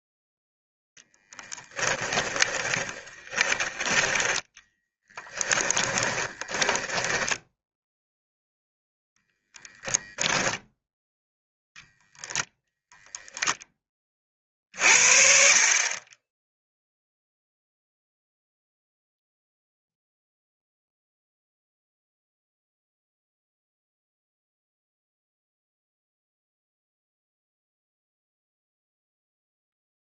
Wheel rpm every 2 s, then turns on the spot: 0, 20, 10, 20, 0, 0, 0, 50, 0, 0, 0, 0, 0, 0, 0.
2-8